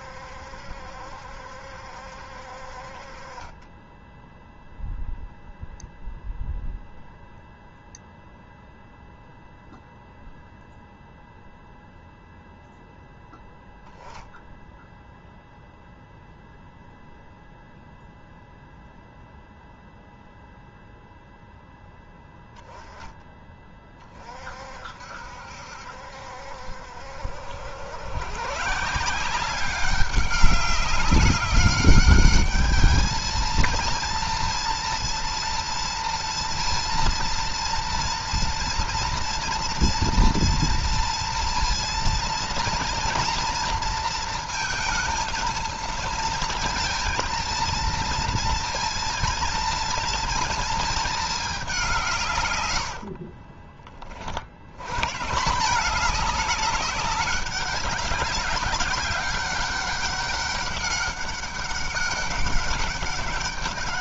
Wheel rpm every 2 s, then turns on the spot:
70, 50, 0, 0, 0, 0, 0, 0, 0, 0, 0, 10, 60, 70, 150, 200, 220, 230, 230, 230, 230, 240, 220, 230, 230, 230, 90, 100, 210, 190, 200, 200.
52-54